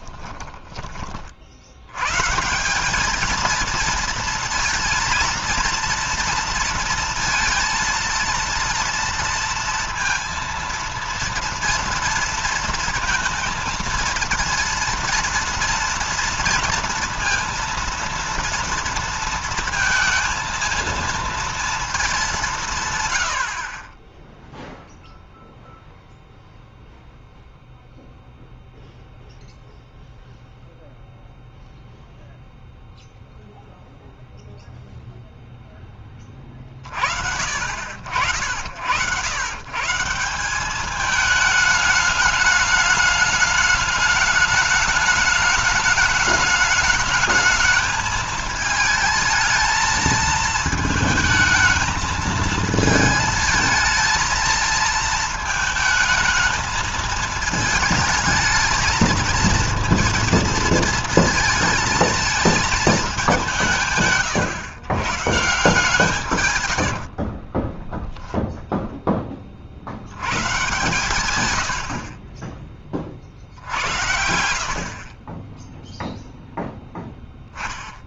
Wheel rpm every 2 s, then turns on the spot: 20, 180, 230, 230, 230, 230, 230, 230, 230, 230, 230, 160, 0, 0, 0, 0, 0, 0, 40, 80, 200, 210, 210, 210, 220, 220, 220, 230, 220, 220, 230, 220, 130, 110, 0, 120, 30, 70, 0.
66-68 74-76